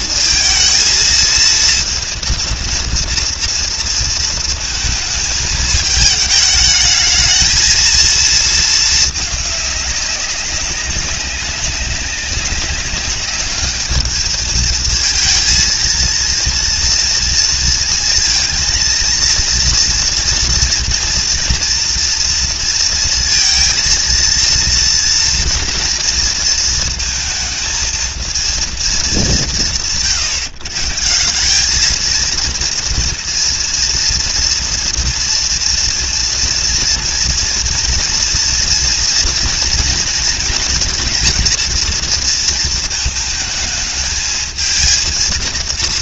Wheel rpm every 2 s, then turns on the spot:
220, 230, 220, 220, 220, 190, 200, 220, 230, 230, 230, 230, 230, 230, 180, 140, 230, 240, 240, 230, 230, 220, 220.
none